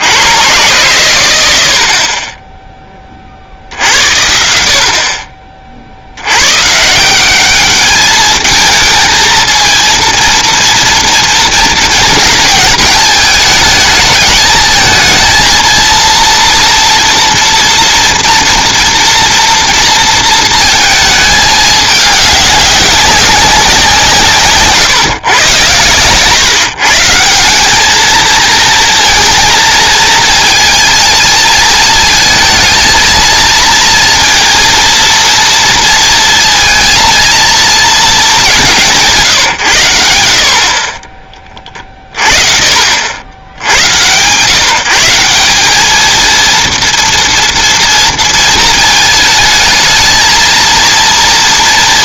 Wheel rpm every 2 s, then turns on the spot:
120, 10, 60, 130, 220, 230, 220, 220, 240, 230, 220, 200, 140, 140, 220, 220, 220, 230, 230, 170, 40, 40, 160, 230, 220, 230.
none